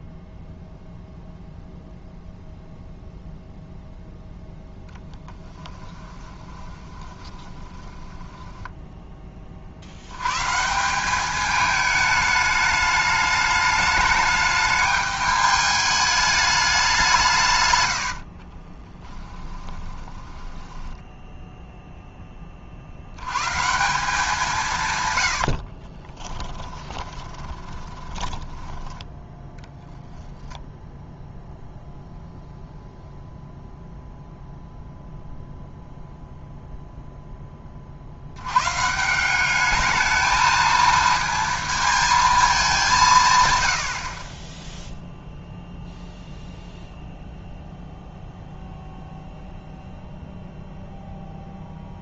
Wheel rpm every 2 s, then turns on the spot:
0, 0, 0, 20, 10, 180, 210, 210, 190, 20, 10, 60, 140, 20, 10, 0, 0, 0, 0, 140, 230, 190, 0, 0, 0, 0.
6-8 18-22 26-30